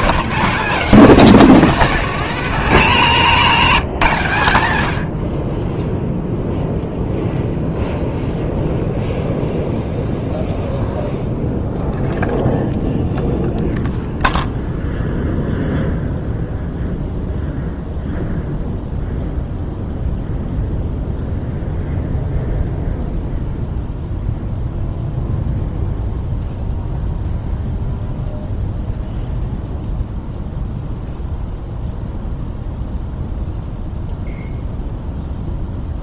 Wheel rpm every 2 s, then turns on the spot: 240, 200, 120, 0, 0, 0, 0, 0, 0, 0, 0, 0, 0, 0, 0, 0, 0, 0.
none